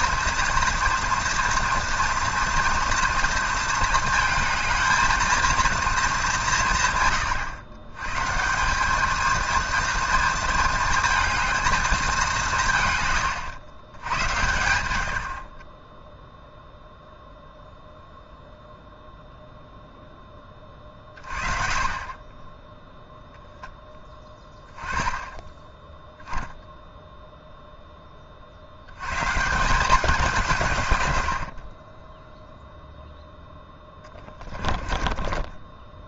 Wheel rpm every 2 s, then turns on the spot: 230, 230, 220, 130, 200, 220, 130, 80, 0, 0, 30, 0, 10, 0, 90, 140, 0, 20.
34-36